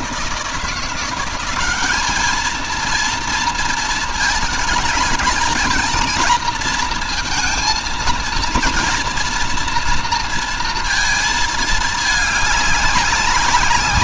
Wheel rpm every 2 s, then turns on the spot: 170, 230, 220, 230, 230, 230, 200.
none